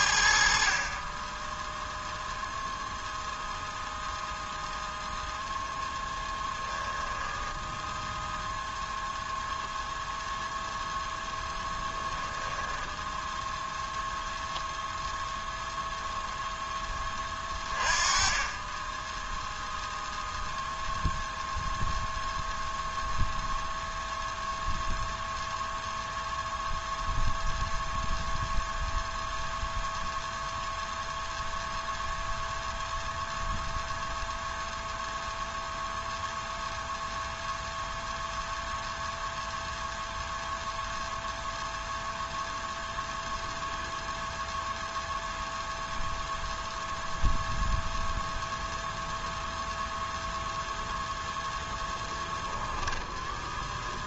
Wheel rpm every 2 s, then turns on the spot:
30, 0, 0, 10, 0, 0, 10, 0, 20, 10, 0, 0, 0, 0, 0, 0, 0, 0, 0, 0, 0, 0, 0, 0, 0, 0, 10.
6-8 12-14 52-54